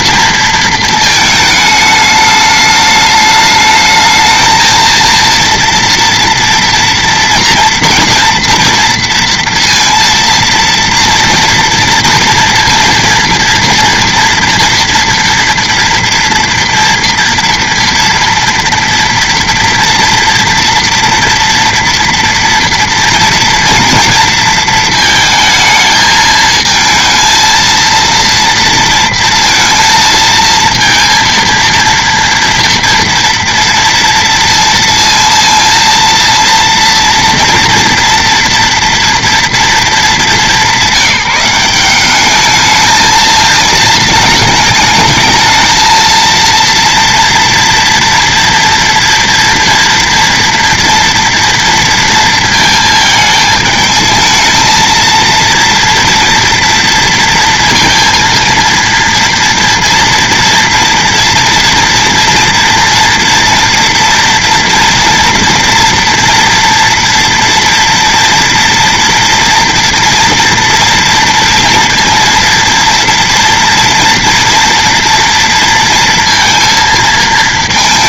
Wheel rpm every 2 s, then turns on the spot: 220, 210, 220, 230, 230, 230, 230, 240, 230, 230, 230, 230, 230, 220, 230, 230, 230, 230, 230, 230, 190, 210, 210, 230, 230, 230, 220, 220, 230, 230, 230, 230, 230, 240, 240, 230, 230, 230, 230.
none